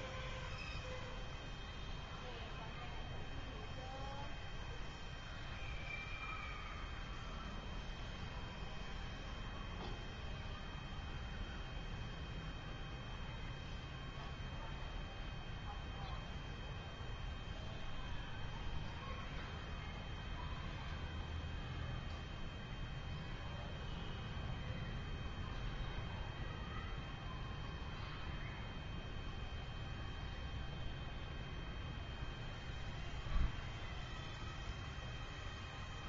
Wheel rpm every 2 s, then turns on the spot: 0, 0, 0, 0, 0, 0, 0, 0, 0, 0, 0, 0, 0, 0, 0, 0, 0, 0.
none